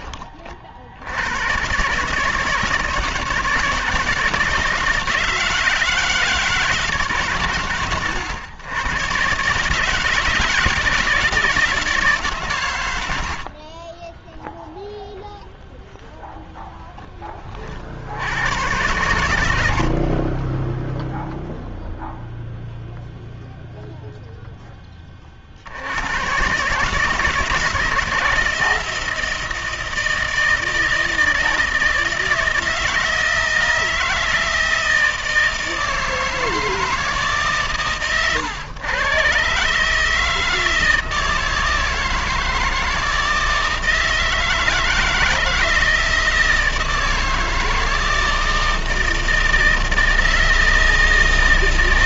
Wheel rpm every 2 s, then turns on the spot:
40, 160, 160, 160, 110, 160, 130, 0, 0, 100, 20, 0, 0, 130, 160, 160, 160, 160, 160, 110, 160, 160, 160, 160, 160, 160.
20-22